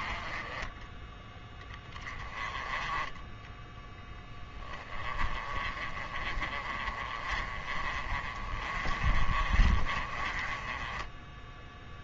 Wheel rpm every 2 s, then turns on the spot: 20, 20, 20, 30, 30, 20.
none